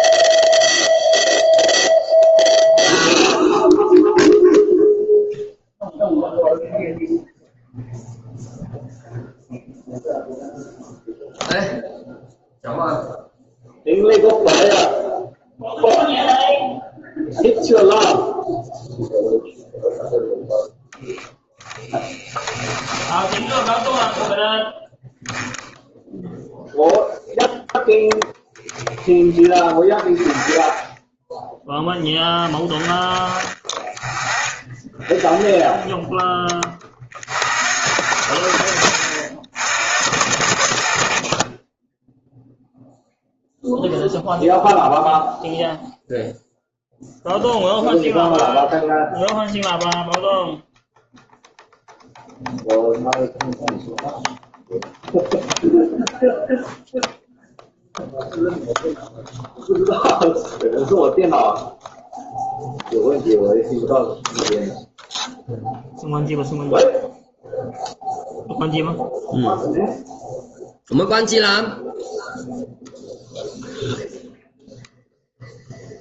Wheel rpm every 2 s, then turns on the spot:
0, 0, 0, 0, 0, 0, 0, 0, 0, 0, 20, 20, 10, 0, 10, 10, 10, 0, 40, 70, 30, 0, 0, 0, 0, 0, 0, 0, 0, 0, 0, 0, 0, 0, 0, 0, 0, 0.
22-24